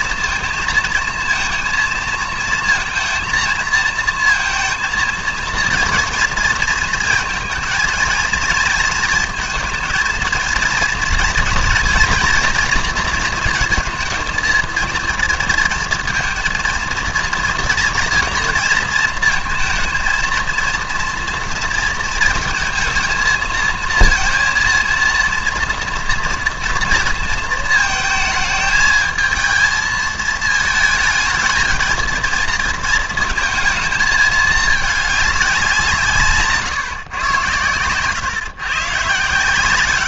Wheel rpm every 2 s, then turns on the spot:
230, 230, 230, 220, 230, 230, 230, 220, 230, 230, 230, 230, 230, 230, 220, 220, 230, 210, 140, 130.
none